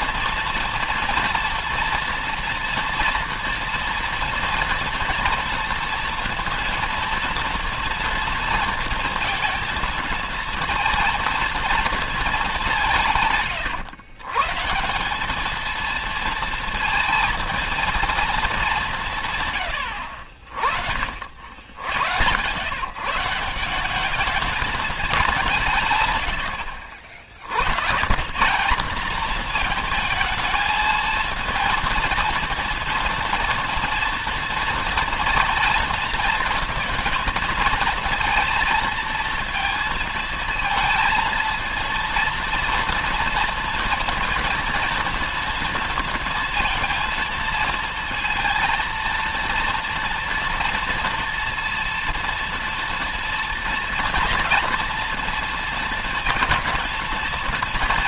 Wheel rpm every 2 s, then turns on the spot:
240, 240, 230, 230, 230, 230, 200, 160, 230, 200, 70, 140, 210, 70, 150, 220, 230, 230, 220, 230, 220, 230, 230, 230, 230, 230, 230, 230, 230.
none